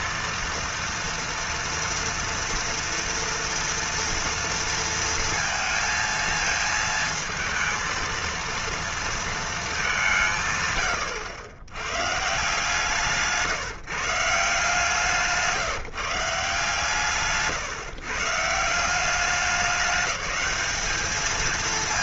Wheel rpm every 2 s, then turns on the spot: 230, 230, 230, 220, 230, 120, 150, 160, 150, 180, 210.
none